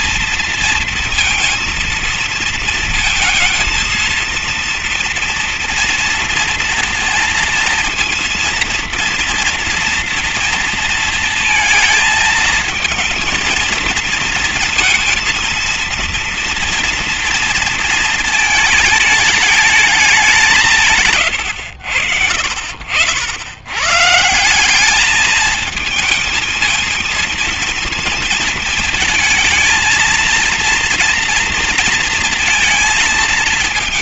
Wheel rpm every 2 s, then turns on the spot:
230, 230, 230, 230, 230, 230, 220, 230, 230, 220, 180, 60, 180, 220, 220, 230, 230.
none